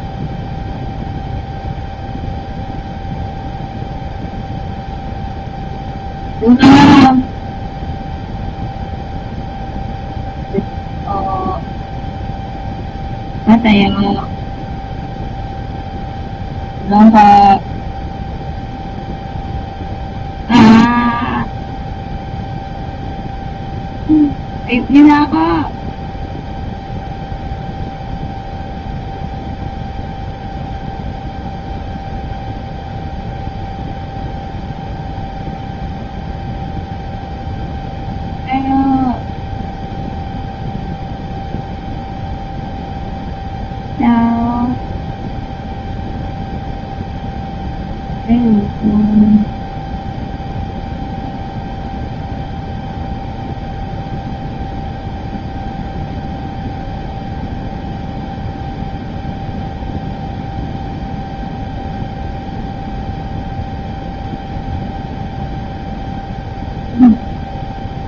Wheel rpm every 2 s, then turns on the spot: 0, 0, 0, 0, 0, 0, 0, 0, 0, 0, 0, 0, 0, 0, 0, 0, 0, 0, 0, 0, 0, 0, 0, 0, 0, 0, 0, 0, 0, 0, 0, 0, 0, 0.
none